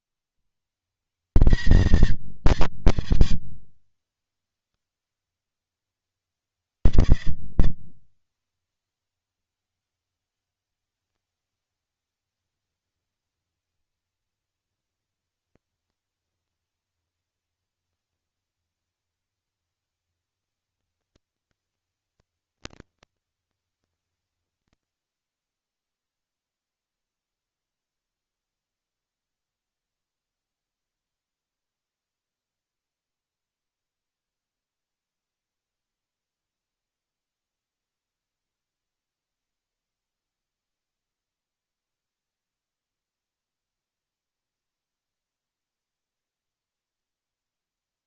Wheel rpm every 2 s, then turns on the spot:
210, 210, 180, 170, 190, 200, 220, 230, 230, 240, 240, 220, 30, 0, 0, 0, 0, 0, 0, 0, 0, 0, 0, 0.
none